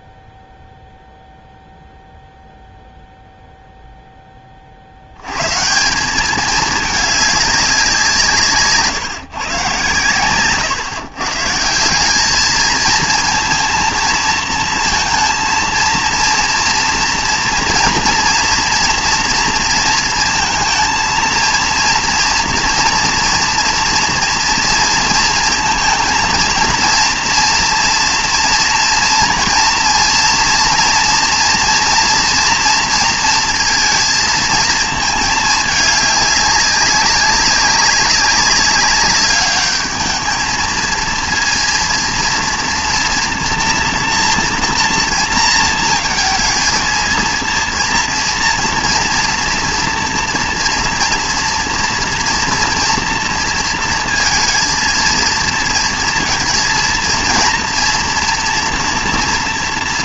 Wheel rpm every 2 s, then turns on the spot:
0, 0, 50, 210, 150, 130, 220, 230, 230, 230, 230, 230, 230, 230, 230, 230, 230, 230, 200, 200, 220, 230, 230, 220, 230, 240, 240, 230, 230, 230.
10-12